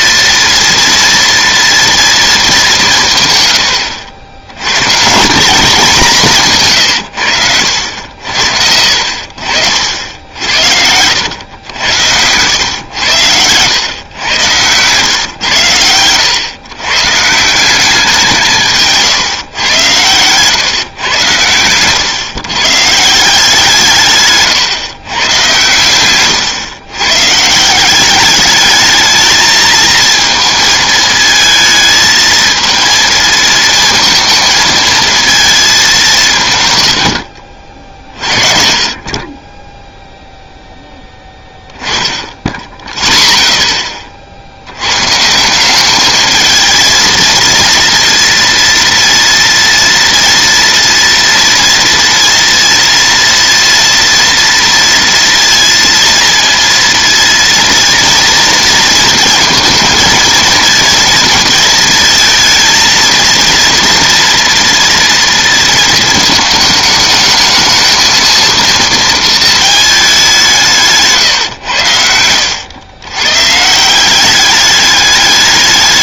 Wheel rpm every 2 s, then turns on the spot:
230, 190, 90, 120, 70, 80, 100, 110, 120, 160, 120, 130, 140, 110, 210, 220, 220, 220, 140, 30, 10, 20, 90, 220, 230, 230, 230, 230, 230, 230, 230, 220, 240, 220, 230, 170, 110, 200.
6-8 40-44